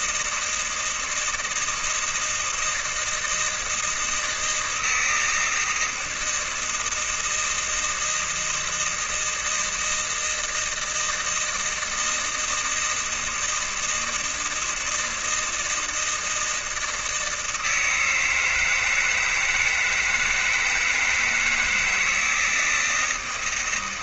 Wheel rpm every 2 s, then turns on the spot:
160, 160, 160, 160, 160, 160, 160, 160, 160, 160, 150, 160.
none